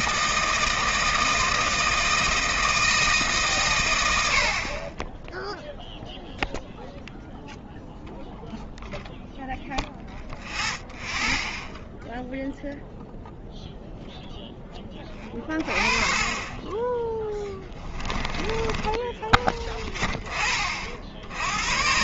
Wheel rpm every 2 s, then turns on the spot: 160, 170, 50, 0, 0, 0, 0, 10, 20, 20, 30.
none